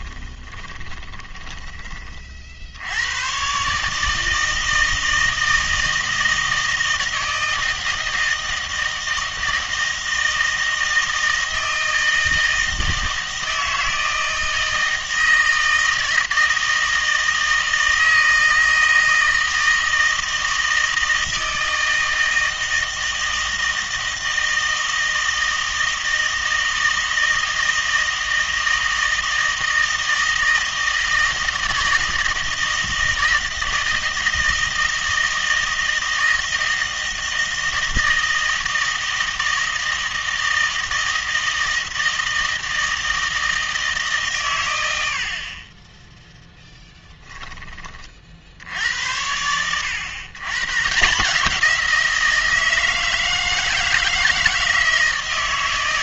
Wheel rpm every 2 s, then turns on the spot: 20, 70, 160, 160, 160, 160, 160, 160, 160, 160, 160, 160, 160, 160, 160, 160, 160, 160, 160, 160, 160, 160, 100, 10, 80, 140, 160, 160.
0-2 46-48